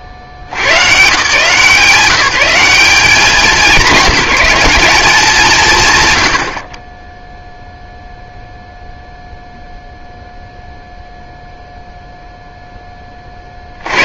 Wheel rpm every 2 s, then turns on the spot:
90, 180, 200, 50, 0, 0, 10.
none